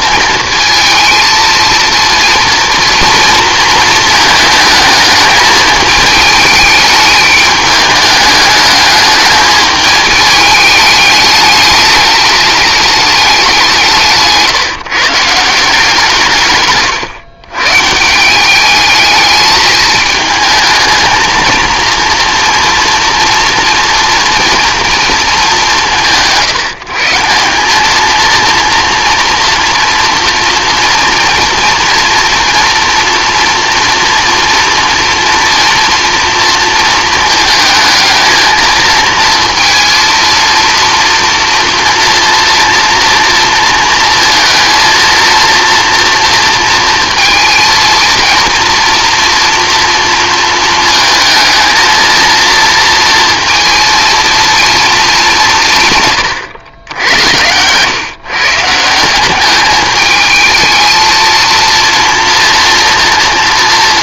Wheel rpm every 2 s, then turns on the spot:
230, 230, 220, 210, 210, 210, 210, 160, 130, 200, 220, 230, 230, 160, 230, 240, 240, 230, 230, 230, 230, 230, 230, 230, 230, 230, 230, 220, 100, 160, 220, 230.
16-18 56-58